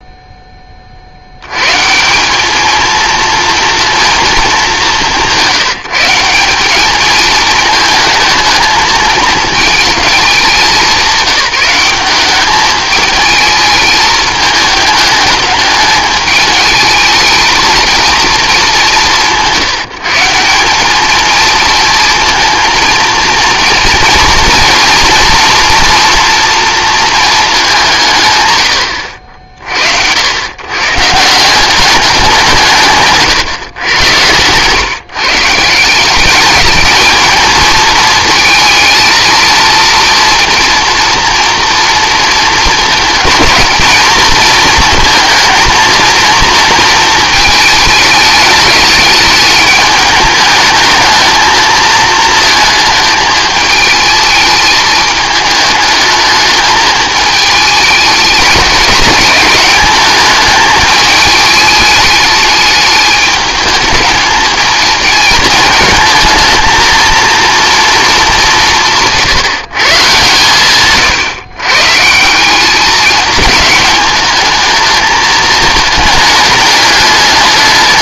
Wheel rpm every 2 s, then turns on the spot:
20, 220, 210, 200, 220, 190, 210, 210, 220, 190, 190, 230, 230, 230, 100, 120, 150, 130, 210, 220, 230, 220, 230, 230, 210, 220, 220, 210, 220, 210, 220, 210, 220, 220, 180, 130, 200, 220, 210.
none